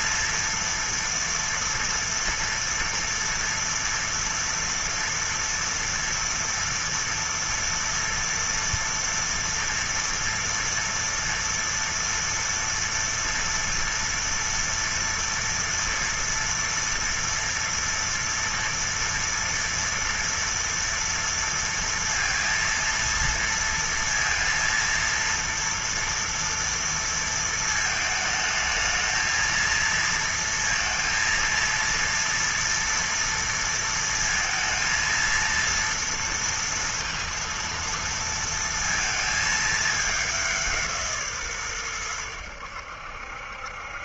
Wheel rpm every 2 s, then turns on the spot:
230, 230, 230, 230, 230, 230, 240, 230, 230, 230, 230, 230, 230, 230, 220, 230, 230, 230, 230, 230, 210, 100.
none